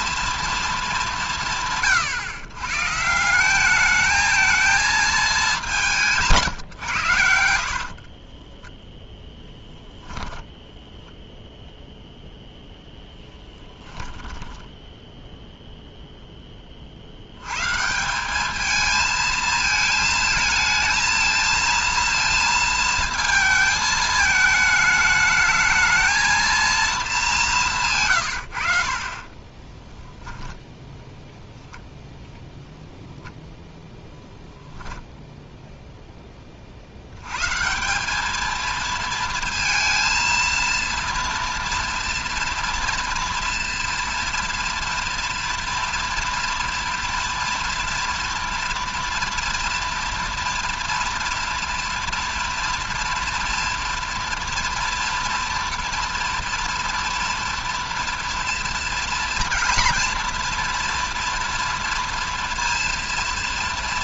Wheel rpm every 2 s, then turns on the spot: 130, 220, 140, 10, 10, 0, 10, 0, 150, 220, 230, 220, 220, 150, 10, 0, 0, 0, 100, 220, 230, 230, 230, 230, 230, 230, 240, 230, 230, 230, 230, 230.
4-10 12-14 26-30